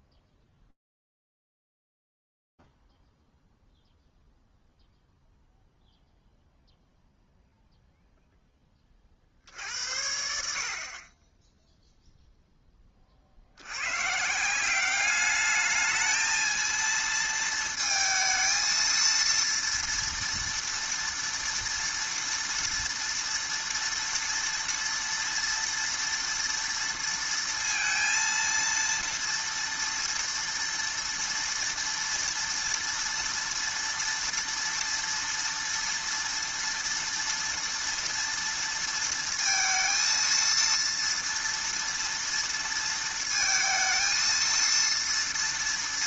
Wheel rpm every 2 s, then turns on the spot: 0, 0, 0, 0, 0, 60, 10, 180, 220, 220, 230, 230, 230, 230, 230, 230, 230, 230, 230, 230, 230, 230, 230.
none